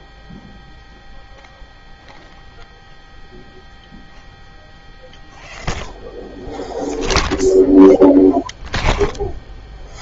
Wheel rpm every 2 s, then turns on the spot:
0, 0, 0, 0, 0.
none